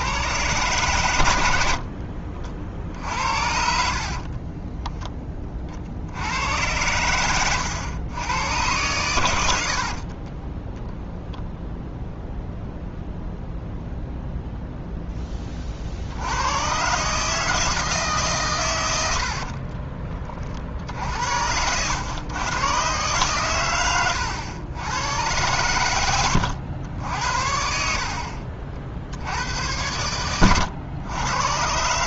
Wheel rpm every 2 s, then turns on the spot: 120, 50, 20, 100, 100, 20, 0, 0, 120, 110, 50, 120, 90, 90, 50, 100.
2-6 20-22